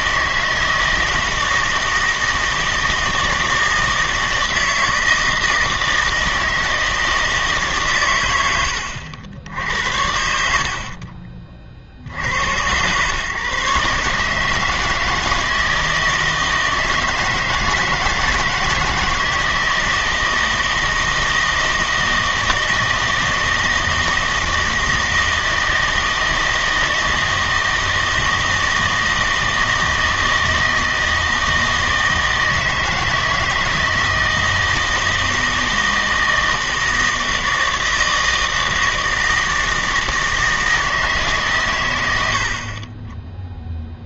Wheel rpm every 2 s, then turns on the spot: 160, 160, 160, 160, 90, 60, 100, 160, 160, 160, 160, 160, 160, 160, 160, 160, 160, 160, 160, 160, 160, 40.
none